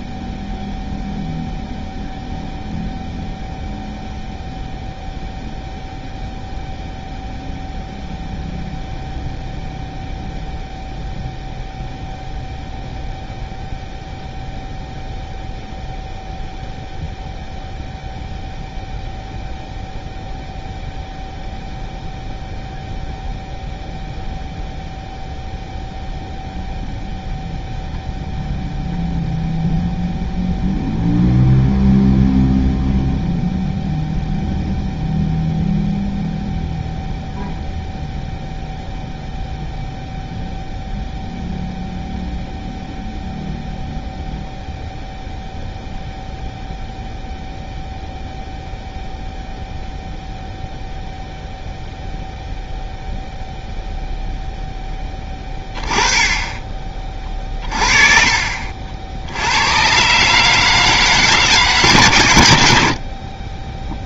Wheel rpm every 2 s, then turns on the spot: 0, 0, 0, 0, 0, 0, 0, 0, 0, 0, 0, 0, 0, 0, 0, 0, 0, 0, 0, 0, 0, 0, 0, 0, 0, 0, 0, 0, 20, 50, 150, 80.
none